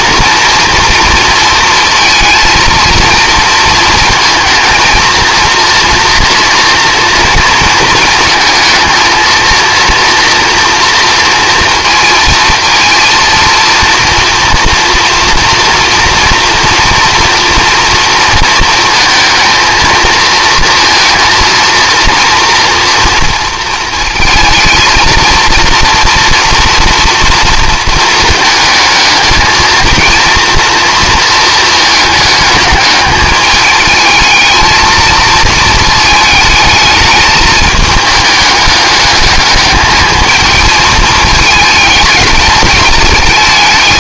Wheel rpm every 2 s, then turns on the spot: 230, 230, 220, 230, 220, 230, 230, 230, 230, 220, 230, 240, 230, 230, 220, 230, 210, 230, 220, 210, 220, 210.
none